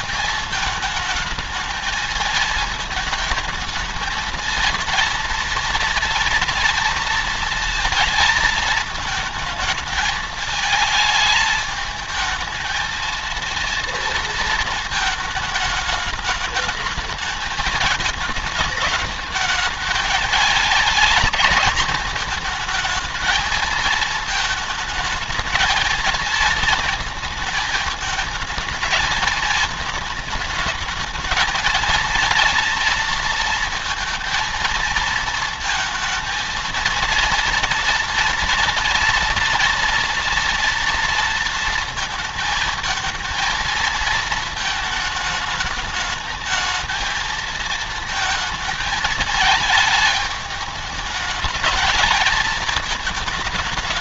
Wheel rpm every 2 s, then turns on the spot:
220, 220, 230, 230, 220, 220, 230, 220, 210, 210, 220, 230, 220, 220, 220, 220, 230, 220, 230, 230, 230, 230, 220, 220, 220, 210, 220.
none